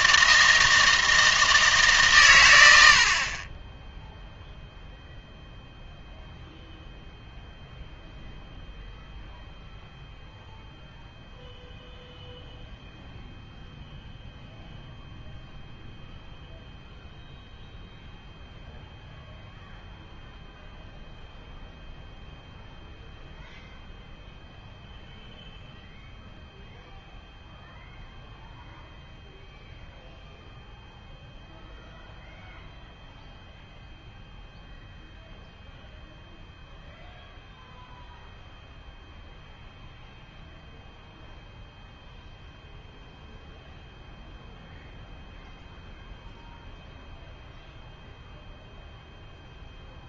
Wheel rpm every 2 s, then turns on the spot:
160, 90, 0, 0, 0, 0, 0, 0, 0, 0, 0, 0, 0, 0, 0, 0, 0, 0, 0, 0, 0, 0, 0, 0, 0.
none